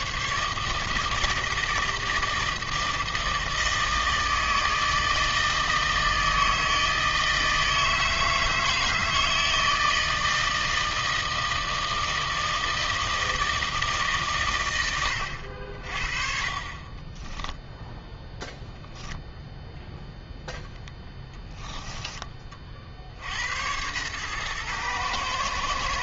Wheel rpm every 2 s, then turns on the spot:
150, 160, 160, 160, 160, 160, 160, 100, 40, 10, 0, 30, 110.
none